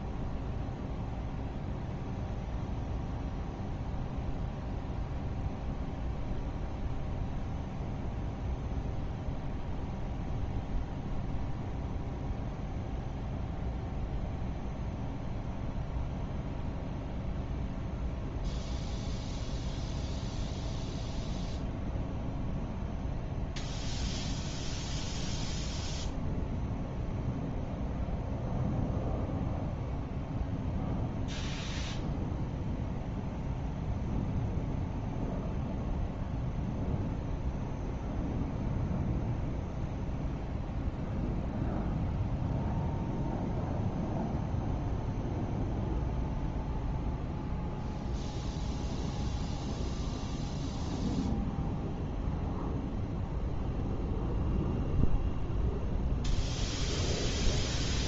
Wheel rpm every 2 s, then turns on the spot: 0, 0, 0, 0, 0, 0, 0, 0, 0, 0, 0, 0, 0, 0, 0, 0, 0, 0, 0, 0, 0, 0, 0, 0, 0, 0, 0, 0, 0.
none